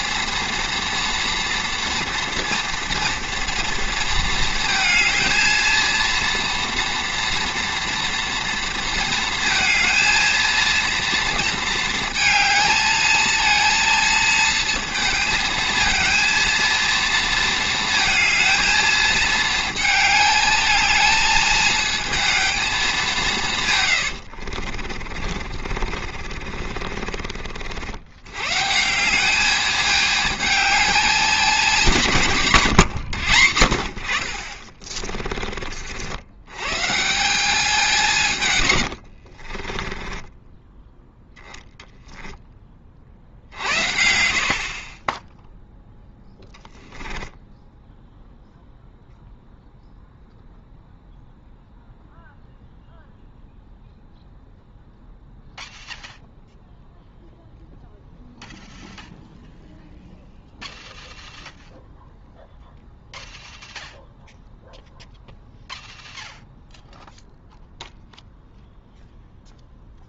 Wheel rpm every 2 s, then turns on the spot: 230, 230, 220, 230, 230, 230, 220, 230, 230, 220, 220, 220, 40, 40, 140, 220, 140, 30, 140, 110, 10, 20, 40, 10, 0, 0, 0, 0, 0, 0, 0, 0, 0, 0, 0.
24-28 34-36 38-42 46-48